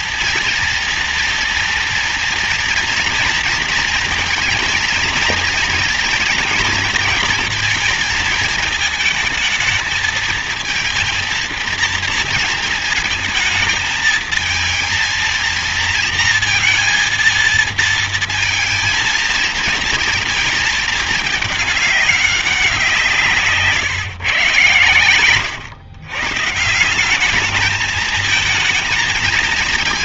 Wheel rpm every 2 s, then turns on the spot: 230, 230, 230, 230, 220, 230, 230, 220, 230, 230, 220, 190, 130, 140, 220.
none